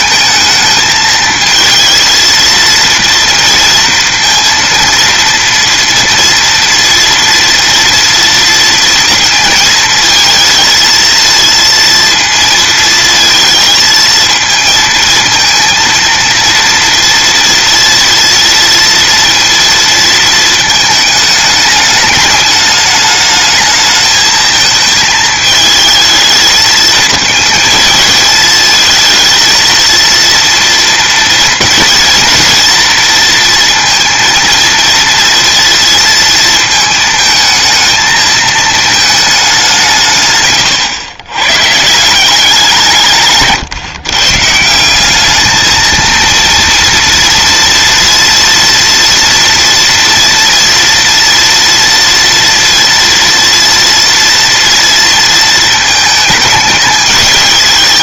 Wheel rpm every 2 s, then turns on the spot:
220, 230, 230, 230, 230, 230, 230, 230, 230, 230, 220, 210, 220, 220, 220, 230, 230, 230, 220, 220, 120, 170, 190, 230, 230, 230, 240, 230, 210.
none